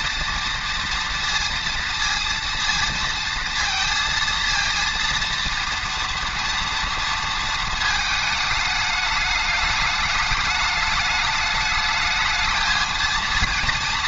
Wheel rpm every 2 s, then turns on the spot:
230, 230, 230, 230, 210, 210, 220.
none